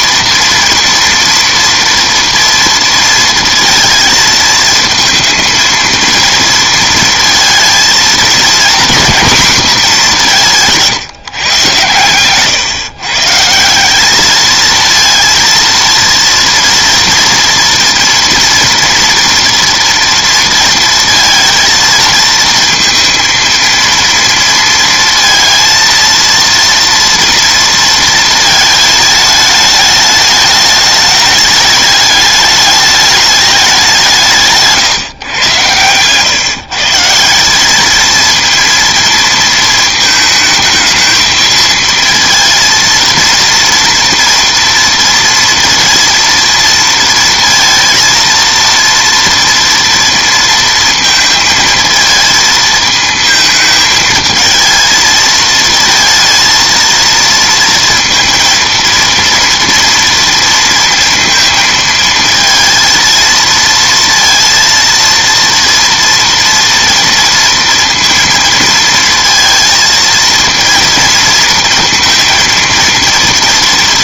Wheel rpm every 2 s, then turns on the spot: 230, 230, 220, 230, 240, 160, 130, 220, 230, 240, 230, 230, 230, 230, 220, 210, 210, 150, 140, 230, 220, 230, 230, 230, 230, 230, 220, 220, 230, 230, 230, 230, 230, 230, 230, 230, 230.
none